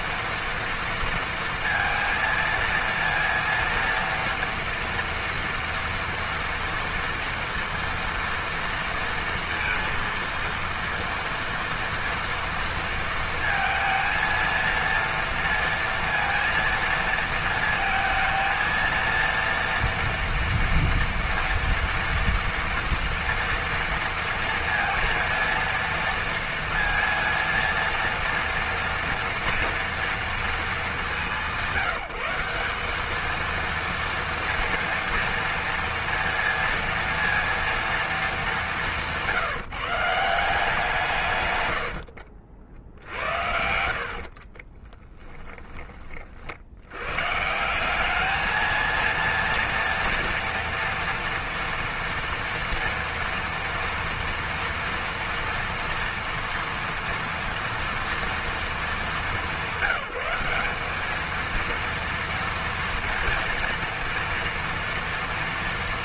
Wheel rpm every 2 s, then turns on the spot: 230, 230, 230, 230, 230, 230, 230, 230, 230, 230, 230, 230, 230, 230, 230, 220, 190, 230, 230, 200, 180, 60, 40, 60, 220, 230, 230, 230, 230, 230, 200, 230, 230.
44-46